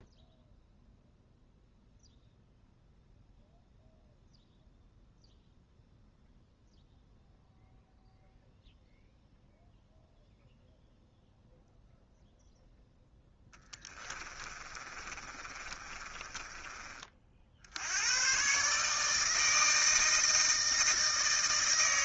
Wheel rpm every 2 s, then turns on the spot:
0, 0, 0, 0, 0, 0, 0, 30, 30, 140, 160.
14-16